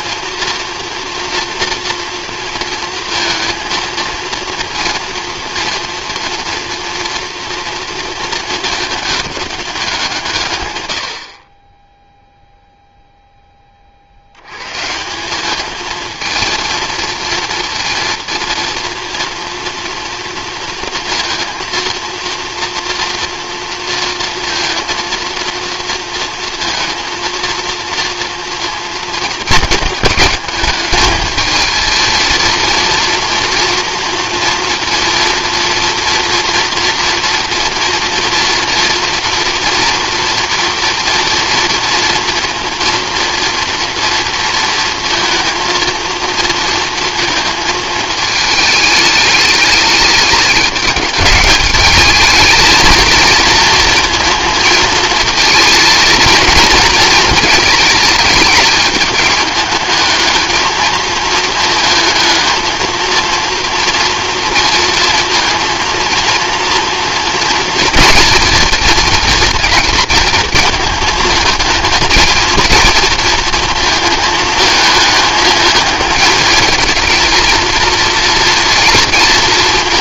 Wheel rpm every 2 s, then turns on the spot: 230, 230, 230, 230, 210, 80, 0, 160, 230, 230, 230, 230, 230, 230, 230, 210, 230, 230, 230, 230, 230, 230, 230, 230, 210, 210, 220, 230, 230, 210, 220, 220, 230, 240, 230, 220, 230, 210, 220, 230.
none